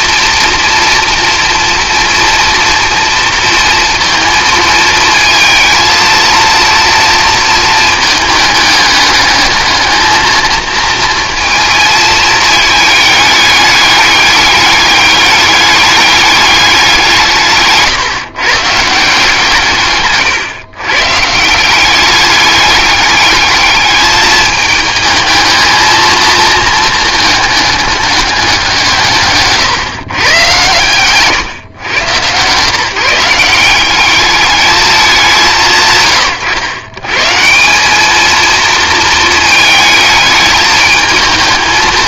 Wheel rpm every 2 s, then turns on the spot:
240, 230, 230, 230, 210, 220, 220, 210, 190, 150, 120, 200, 220, 220, 180, 130, 150, 210, 120, 230, 220.
none